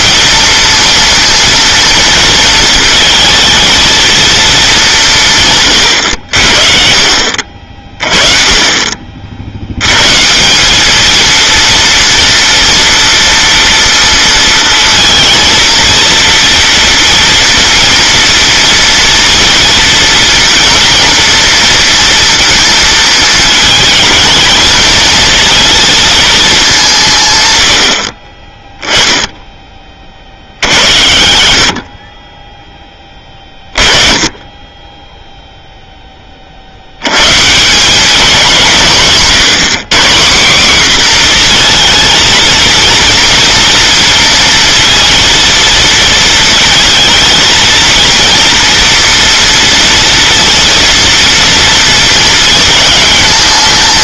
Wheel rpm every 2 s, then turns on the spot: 230, 220, 200, 60, 30, 200, 230, 220, 230, 230, 230, 230, 220, 190, 10, 80, 10, 10, 70, 170, 220, 230, 230, 230, 240, 230, 220.
none